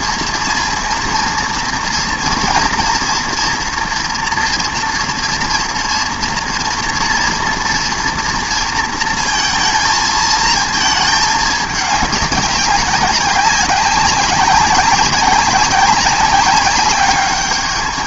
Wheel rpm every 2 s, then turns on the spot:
230, 230, 230, 240, 230, 220, 200, 200, 190.
none